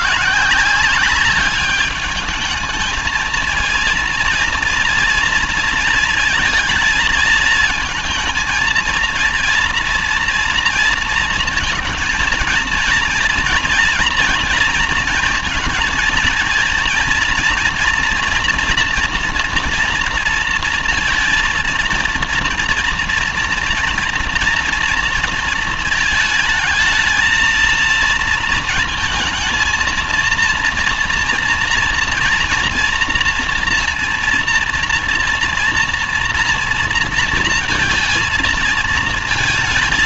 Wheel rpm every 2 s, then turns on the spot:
180, 220, 230, 220, 230, 230, 230, 230, 230, 240, 230, 230, 230, 220, 230, 230, 240, 230, 230, 230.
none